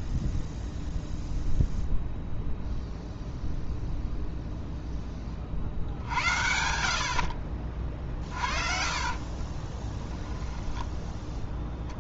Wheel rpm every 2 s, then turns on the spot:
0, 0, 0, 60, 50, 10.
8-12